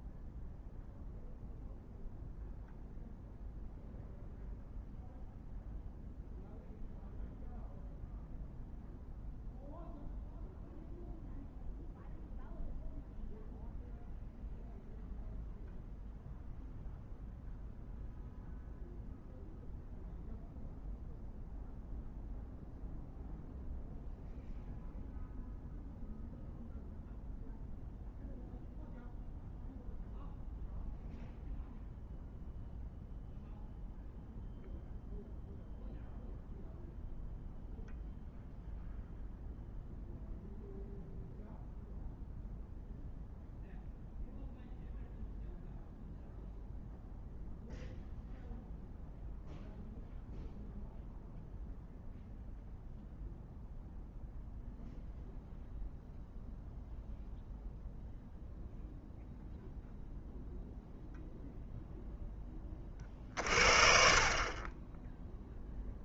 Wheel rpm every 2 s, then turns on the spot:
0, 0, 0, 0, 0, 0, 0, 0, 0, 0, 0, 0, 0, 0, 0, 0, 0, 0, 0, 0, 0, 0, 0, 0, 0, 0, 0, 0, 0, 0, 0, 20, 20.
none